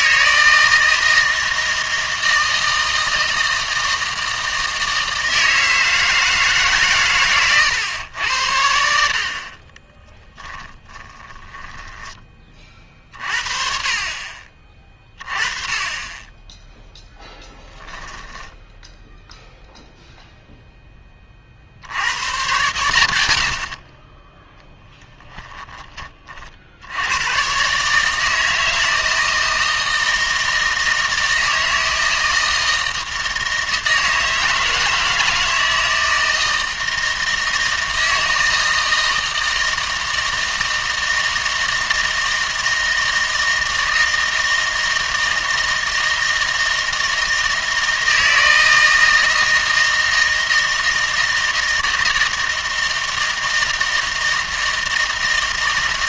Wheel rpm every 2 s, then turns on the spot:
160, 160, 160, 140, 70, 20, 40, 30, 10, 10, 10, 110, 10, 80, 160, 160, 160, 160, 160, 160, 160, 160, 160, 160, 160, 160, 160, 160.
10-12